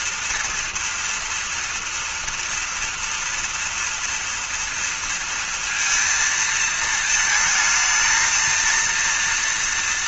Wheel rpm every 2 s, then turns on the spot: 240, 230, 230, 220, 230.
none